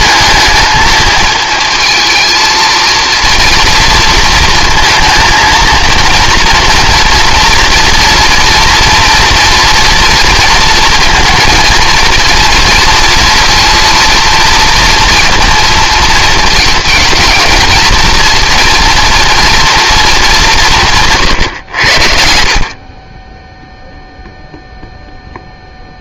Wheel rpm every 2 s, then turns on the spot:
220, 230, 230, 230, 230, 230, 230, 230, 220, 230, 160, 40, 0.
none